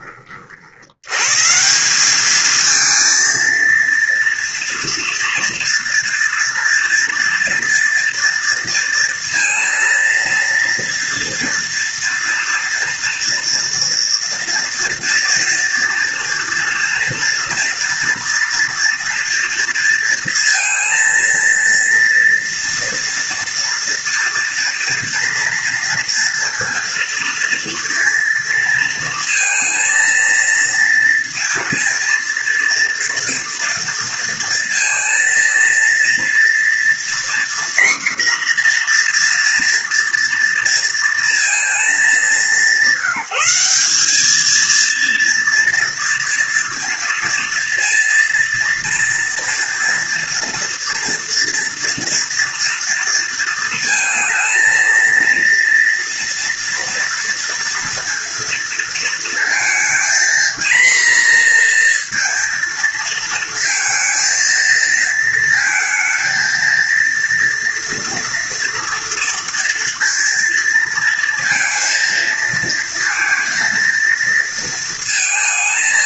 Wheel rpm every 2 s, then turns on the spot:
40, 210, 230, 230, 230, 230, 240, 230, 230, 230, 230, 230, 230, 230, 230, 230, 230, 230, 230, 250, 230, 210, 220, 230, 230, 240, 230, 230, 230, 230, 230, 230, 230, 220, 230, 230, 230, 230.
none